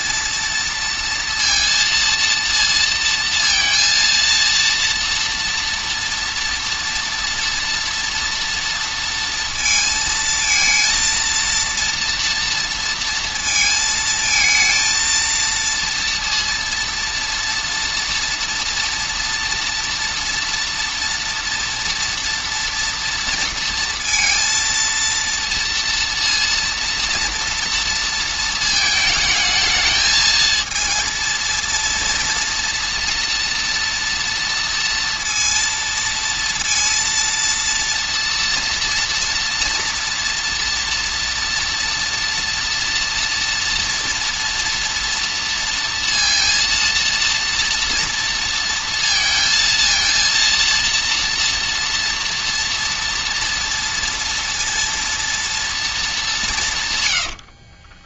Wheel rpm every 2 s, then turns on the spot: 230, 230, 230, 230, 230, 230, 230, 220, 230, 240, 230, 230, 230, 230, 220, 230, 230, 230, 230, 230, 230, 240, 230, 230, 230, 230, 240, 230, 170.
none